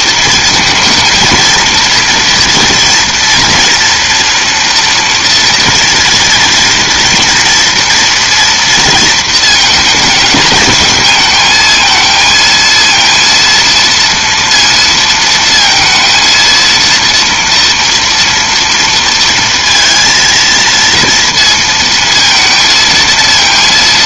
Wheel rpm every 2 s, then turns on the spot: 230, 240, 230, 230, 240, 220, 230, 230, 230, 230, 230, 230.
none